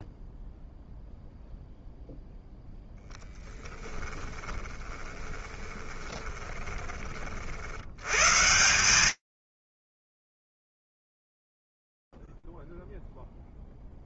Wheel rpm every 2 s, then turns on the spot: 0, 0, 20, 30, 140, 0, 0.
4-6